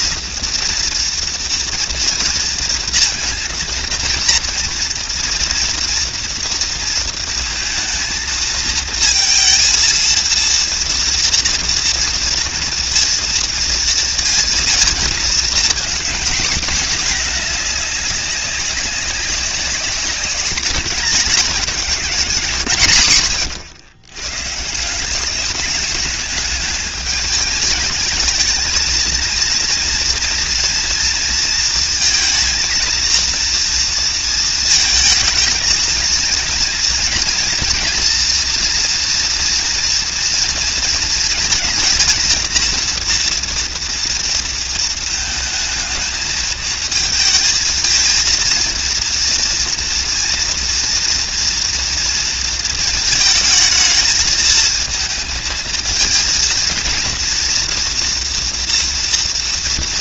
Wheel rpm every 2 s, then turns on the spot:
240, 230, 230, 230, 230, 230, 230, 230, 230, 190, 200, 90, 180, 220, 230, 230, 230, 220, 230, 230, 220, 230, 220, 220, 230, 230, 220, 220, 230, 230.
none